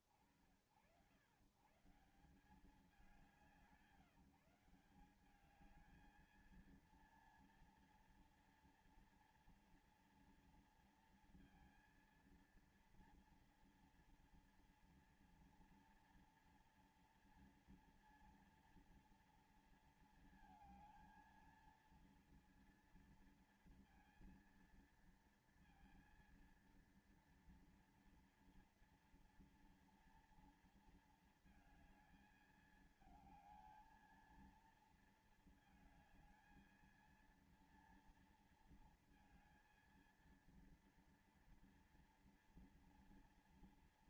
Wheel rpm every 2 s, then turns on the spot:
40, 140, 170, 220, 230, 230, 230, 230, 230, 230, 230, 230, 230, 230, 230, 230, 220, 230, 220, 230, 230, 230.
none